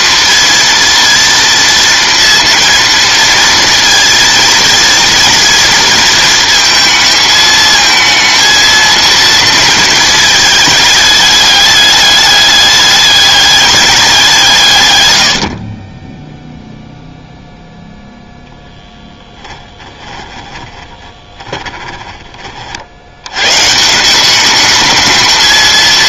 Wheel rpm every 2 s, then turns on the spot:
230, 230, 230, 220, 230, 220, 210, 150, 0, 0, 20, 40, 210.
20-22